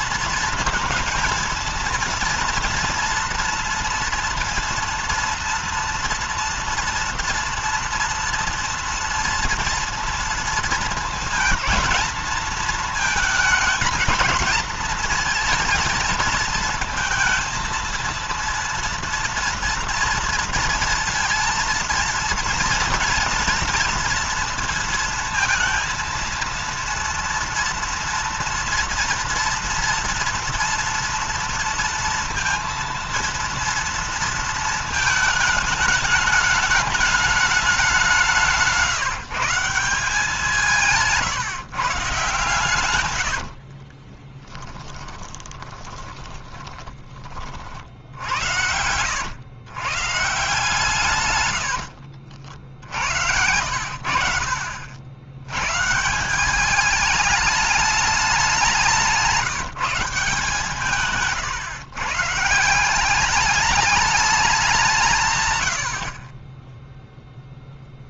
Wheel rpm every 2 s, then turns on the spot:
230, 230, 230, 230, 230, 230, 220, 220, 220, 230, 230, 230, 230, 230, 230, 230, 230, 230, 210, 170, 170, 140, 20, 10, 80, 140, 80, 80, 190, 180, 160, 160, 190, 10.
38-40 42-48 52-54 60-62